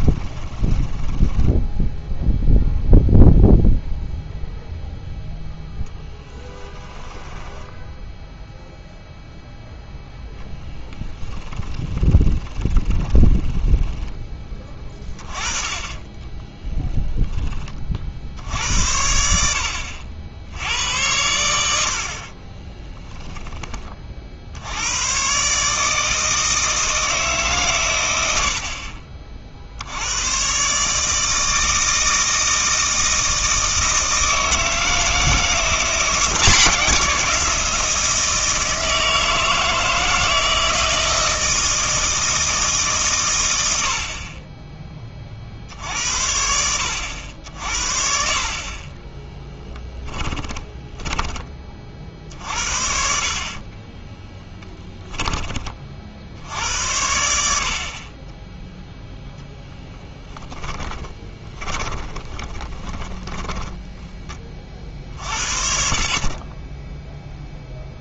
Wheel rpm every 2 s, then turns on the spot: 10, 0, 0, 0, 0, 10, 20, 20, 10, 80, 80, 20, 90, 160, 50, 140, 160, 160, 180, 160, 160, 140, 20, 90, 30, 10, 60, 10, 80, 0, 10, 20, 40, 10.
0-2 10-16 22-24 50-52 54-56 60-64